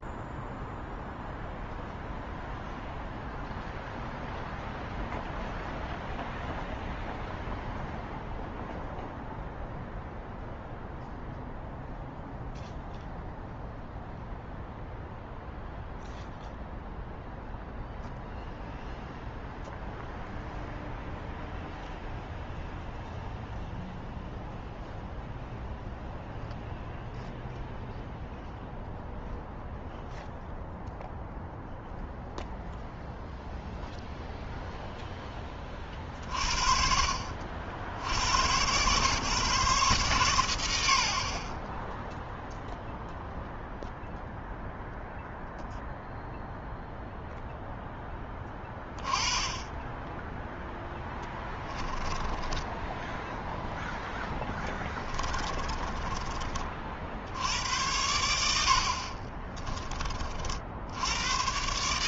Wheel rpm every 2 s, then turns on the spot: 0, 0, 0, 0, 0, 0, 0, 0, 0, 0, 0, 0, 0, 0, 0, 0, 0, 0, 40, 120, 110, 0, 0, 0, 20, 10, 10, 10, 30, 70, 60.
50-56